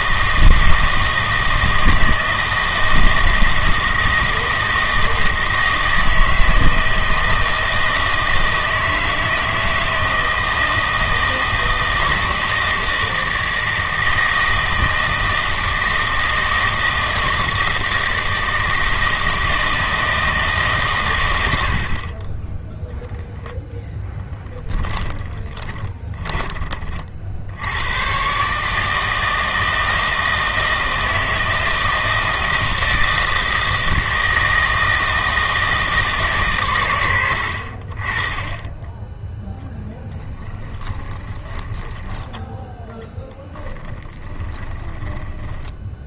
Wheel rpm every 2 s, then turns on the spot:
160, 160, 160, 160, 160, 160, 160, 160, 160, 160, 140, 0, 10, 30, 150, 160, 160, 160, 110, 10, 20, 10, 20.
24-26 40-42 44-46